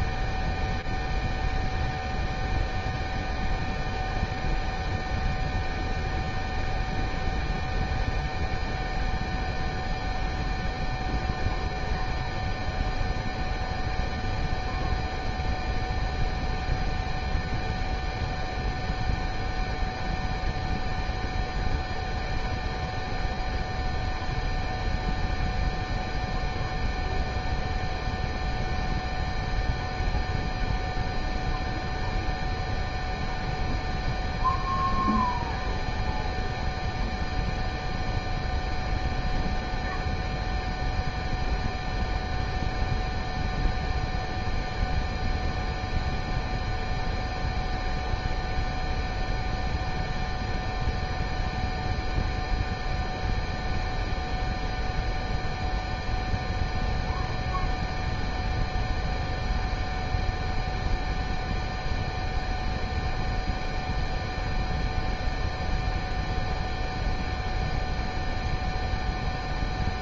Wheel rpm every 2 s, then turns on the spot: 0, 0, 0, 0, 0, 0, 0, 0, 0, 0, 0, 0, 0, 0, 0, 0, 0, 0, 0, 0, 0, 0, 0, 0, 0, 0, 0, 0, 0, 0, 0, 0, 0, 0, 0.
none